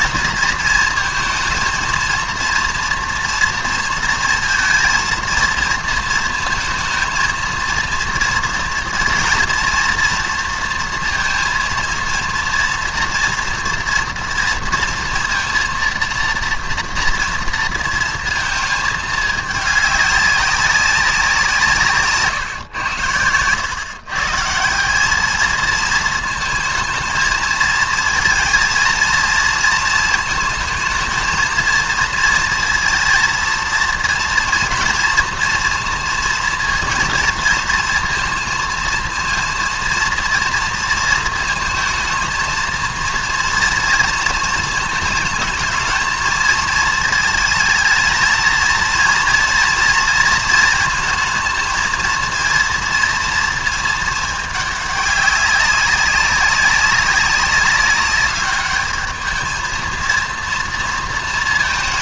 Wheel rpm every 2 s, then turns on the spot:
230, 230, 230, 230, 230, 230, 230, 230, 230, 230, 200, 140, 140, 220, 230, 230, 230, 230, 230, 230, 230, 230, 230, 220, 220, 230, 230, 220, 190, 200, 230.
none